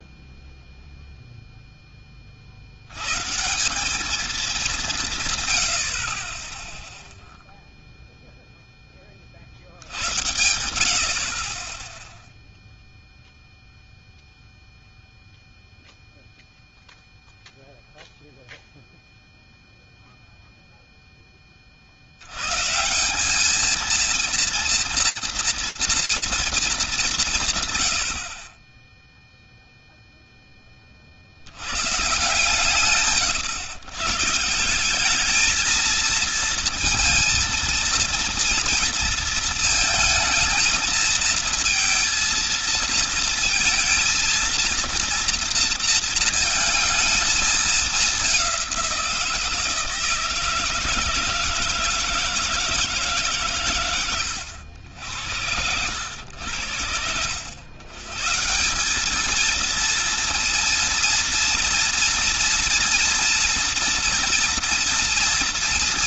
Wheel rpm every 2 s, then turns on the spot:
0, 50, 190, 10, 0, 60, 0, 0, 0, 0, 0, 110, 230, 230, 60, 20, 130, 150, 230, 230, 220, 220, 230, 230, 190, 160, 160, 90, 80, 200, 230, 230, 230.
none